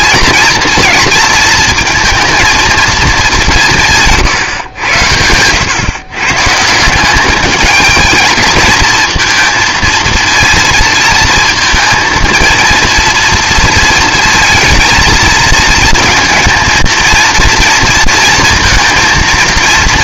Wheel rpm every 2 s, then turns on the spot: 230, 230, 110, 160, 220, 230, 230, 220, 230, 230.
none